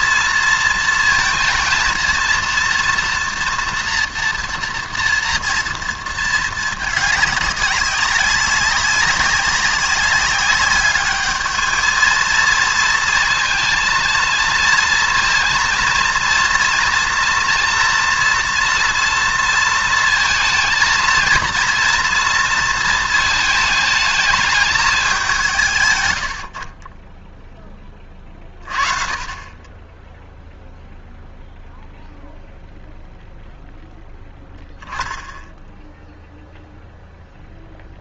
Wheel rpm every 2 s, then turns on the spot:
230, 230, 230, 220, 190, 200, 230, 230, 230, 240, 230, 230, 220, 50, 30, 0, 0, 0, 0.
none